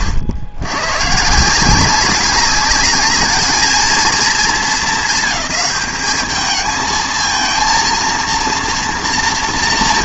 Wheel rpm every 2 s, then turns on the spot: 120, 190, 200, 220, 230.
none